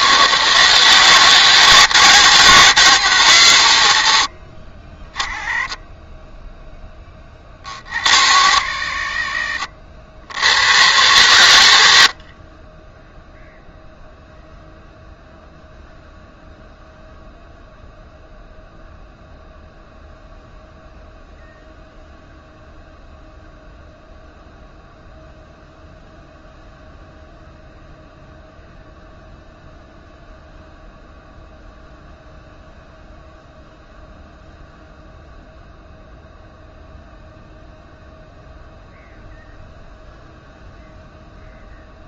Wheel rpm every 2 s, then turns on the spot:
140, 160, 60, 20, 110, 100, 30, 0, 0, 0, 0, 0, 0, 0, 0, 0, 0, 0, 0, 0, 0.
none